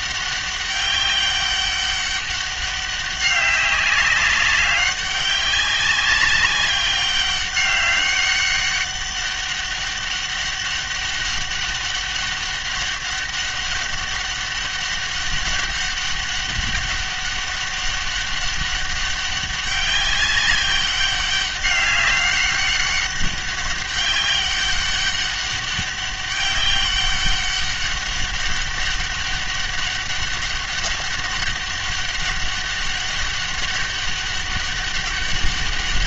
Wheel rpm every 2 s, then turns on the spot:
200, 200, 190, 200, 200, 200, 200, 200, 200, 200, 200, 200, 200, 200, 200, 200, 200, 200.
none